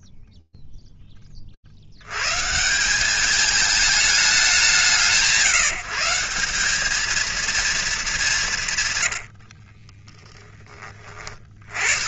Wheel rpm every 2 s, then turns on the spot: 90, 210, 170, 220, 20, 20.
8-12